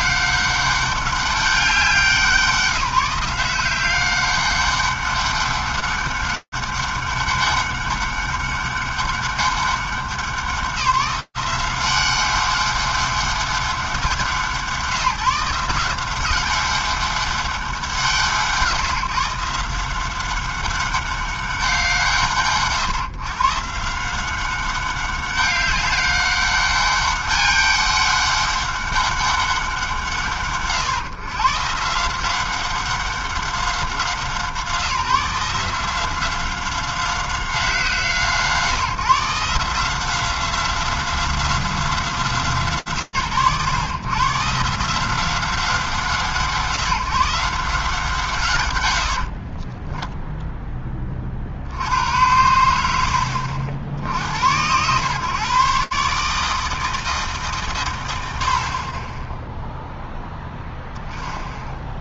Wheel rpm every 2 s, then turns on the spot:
200, 180, 200, 200, 200, 180, 200, 160, 200, 160, 190, 120, 190, 200, 200, 110, 190, 170, 180, 150, 180, 140, 160, 160, 130, 0, 80, 110, 150, 40, 0.
none